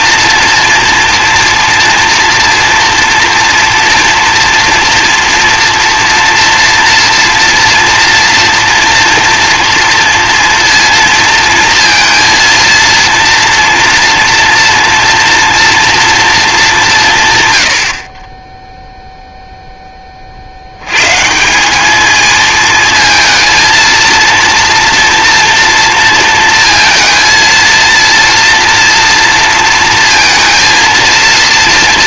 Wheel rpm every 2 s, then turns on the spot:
240, 230, 230, 230, 230, 230, 230, 230, 210, 10, 90, 220, 230, 230, 230, 230.
none